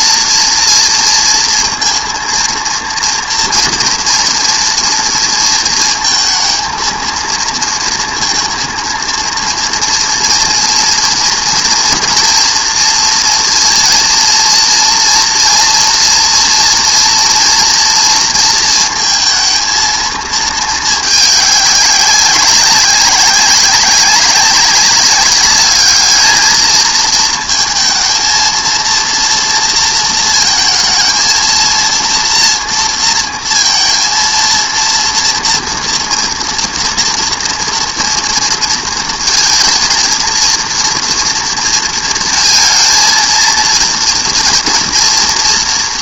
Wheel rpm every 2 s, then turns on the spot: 230, 230, 240, 220, 230, 230, 230, 230, 230, 230, 220, 190, 190, 220, 230, 230, 230, 230, 230, 230, 230, 230, 230.
none